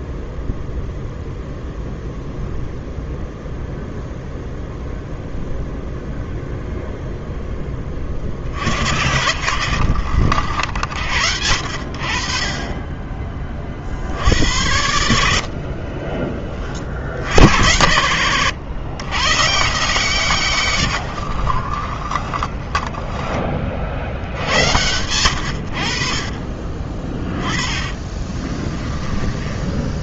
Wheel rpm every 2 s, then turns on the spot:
0, 0, 0, 0, 60, 80, 20, 80, 50, 120, 100, 20, 100, 20, 20.
20-24 28-30